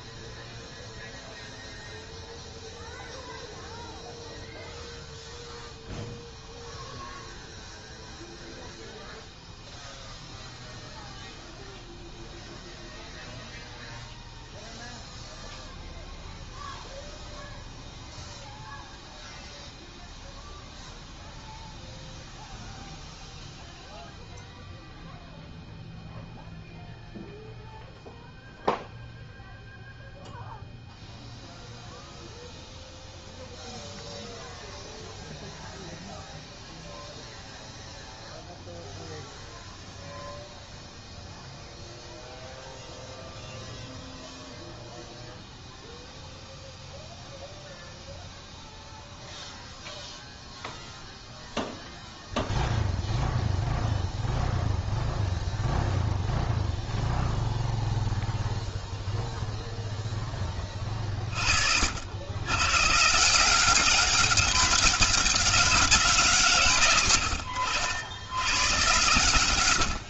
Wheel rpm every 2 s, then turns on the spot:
0, 0, 0, 0, 0, 0, 0, 0, 0, 0, 0, 0, 0, 0, 0, 0, 0, 0, 0, 0, 0, 0, 0, 0, 0, 0, 0, 0, 0, 0, 30, 140, 200, 140, 130.
none